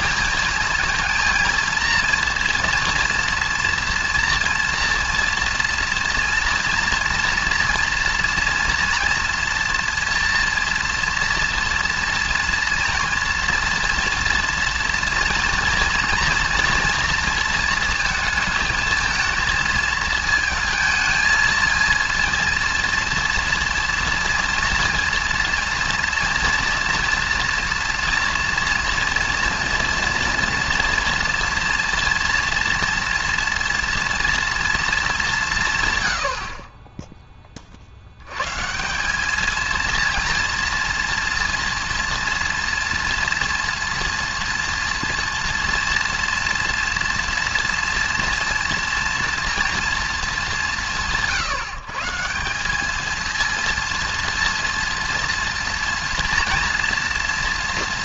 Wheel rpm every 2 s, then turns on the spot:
230, 230, 230, 230, 230, 230, 230, 230, 230, 220, 230, 230, 230, 230, 230, 230, 230, 230, 30, 160, 230, 230, 230, 230, 230, 190, 190, 230, 240.
none